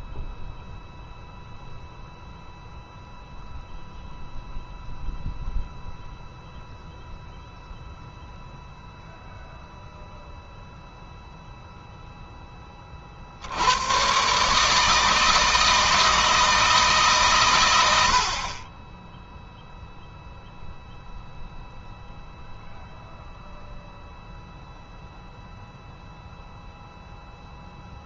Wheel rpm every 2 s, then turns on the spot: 0, 0, 0, 0, 0, 0, 30, 150, 150, 20, 0, 0, 0, 0.
none